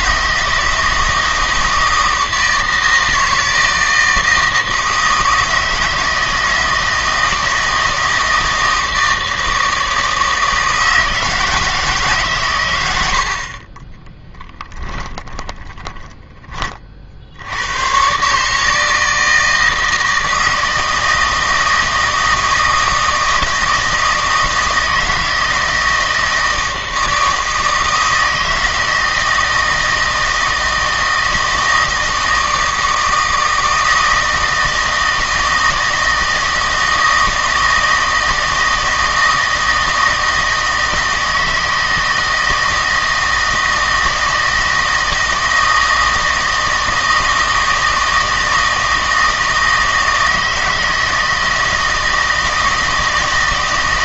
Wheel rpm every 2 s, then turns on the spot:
160, 160, 160, 160, 160, 160, 110, 10, 30, 160, 160, 160, 160, 160, 160, 160, 160, 160, 160, 160, 160, 160, 160, 160, 160, 160, 160.
14-16